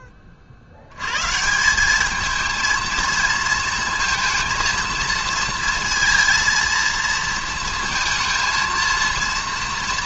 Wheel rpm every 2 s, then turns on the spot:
60, 220, 230, 230, 230.
none